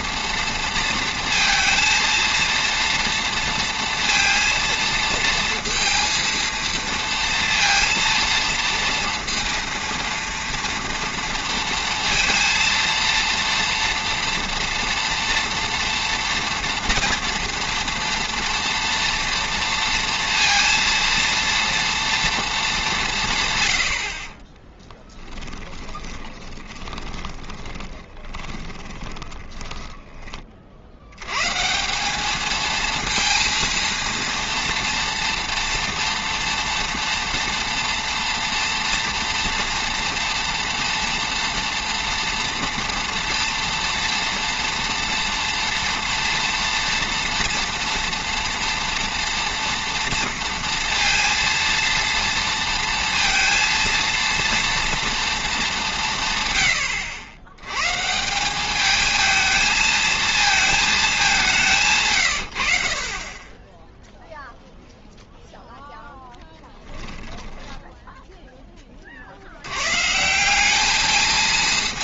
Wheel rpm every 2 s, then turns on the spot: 230, 230, 230, 230, 230, 230, 230, 230, 230, 230, 230, 210, 20, 20, 20, 40, 220, 230, 230, 230, 230, 240, 240, 240, 230, 230, 230, 230, 110, 200, 220, 60, 0, 10, 10, 200.
24-30 66-68